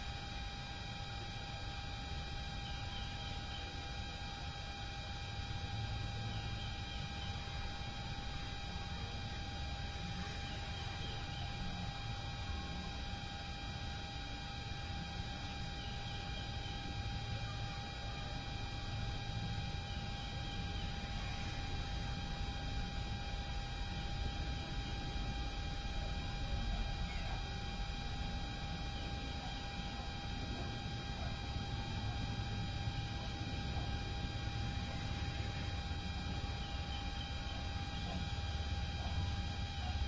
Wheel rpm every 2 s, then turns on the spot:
0, 0, 0, 0, 0, 0, 0, 0, 0, 0, 0, 0, 0, 0, 0, 0, 0, 0, 0, 0.
none